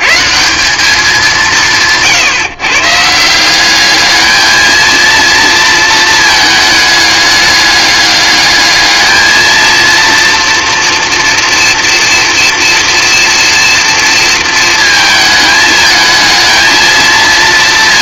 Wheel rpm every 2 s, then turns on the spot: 200, 150, 220, 210, 210, 230, 230, 220, 220.
none